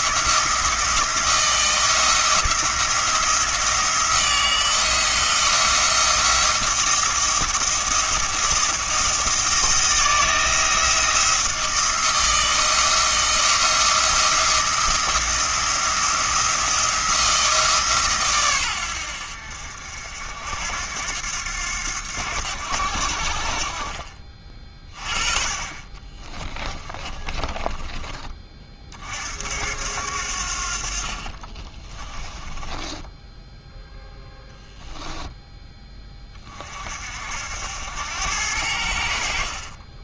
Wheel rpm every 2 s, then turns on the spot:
170, 160, 160, 170, 170, 170, 170, 170, 170, 100, 80, 80, 30, 20, 40, 50, 10, 0, 50, 80.
26-28 32-34